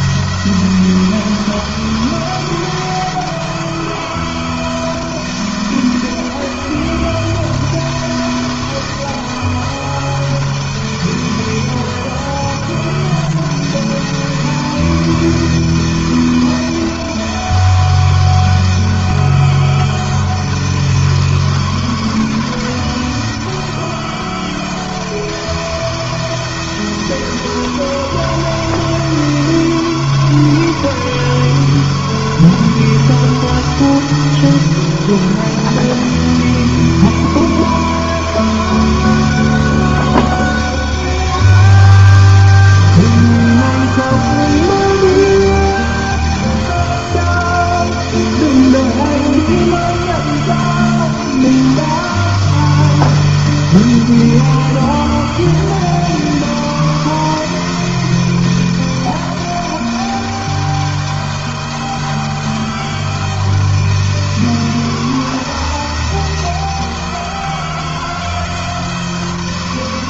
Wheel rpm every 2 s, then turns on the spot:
160, 160, 160, 160, 160, 160, 160, 160, 160, 160, 160, 160, 160, 160, 160, 160, 160, 160, 150, 150, 160, 160, 160, 160, 160, 160, 170, 160, 160, 160, 160, 160, 160, 160, 160.
none